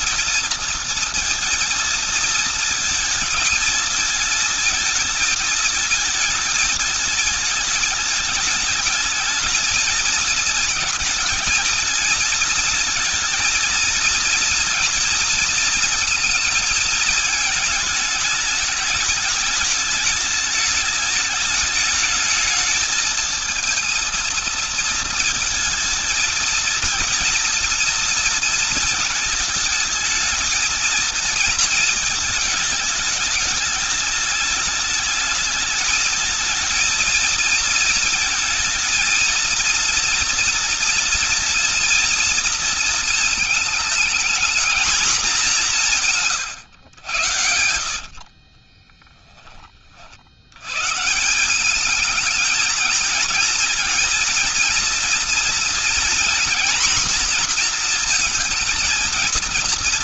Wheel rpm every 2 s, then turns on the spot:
230, 230, 220, 220, 220, 230, 230, 230, 220, 220, 210, 220, 230, 230, 230, 220, 210, 220, 230, 230, 230, 230, 230, 110, 20, 140, 220, 230, 240, 230.
48-50